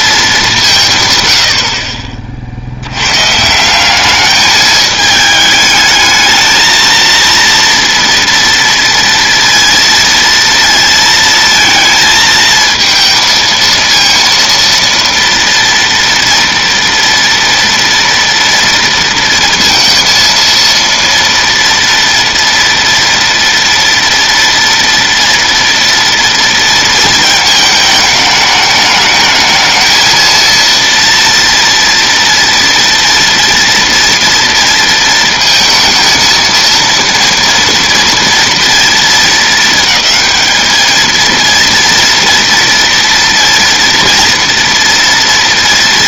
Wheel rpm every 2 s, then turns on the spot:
150, 90, 210, 230, 230, 230, 220, 230, 230, 230, 230, 230, 230, 230, 210, 230, 230, 230, 230, 220, 220, 230, 230.
none